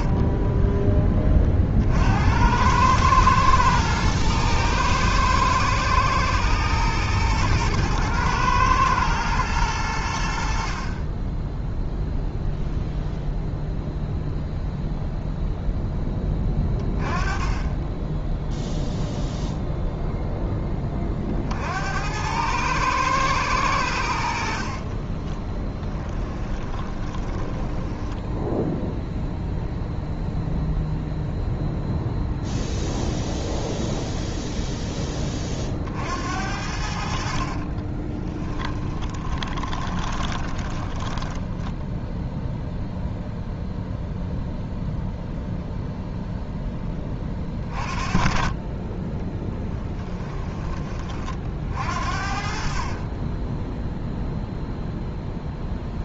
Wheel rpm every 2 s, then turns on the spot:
10, 100, 110, 120, 110, 40, 0, 0, 20, 0, 20, 110, 40, 20, 0, 0, 0, 0, 60, 20, 10, 0, 0, 10, 20, 20, 40, 0.
24-28 38-42